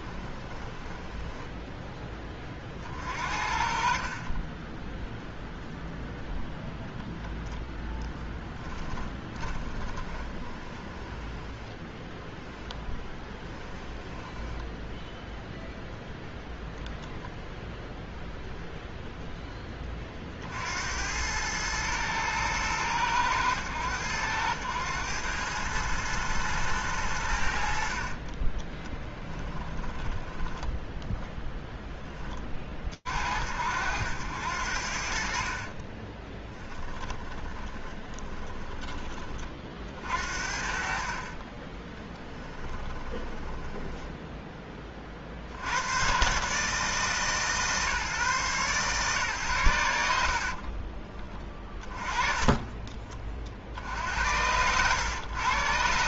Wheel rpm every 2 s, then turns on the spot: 20, 30, 10, 0, 10, 20, 0, 10, 0, 0, 90, 110, 100, 100, 10, 10, 40, 80, 10, 20, 40, 20, 40, 150, 130, 30, 60, 100.
0-2 8-12 14-16 28-32 36-38 40-44 50-52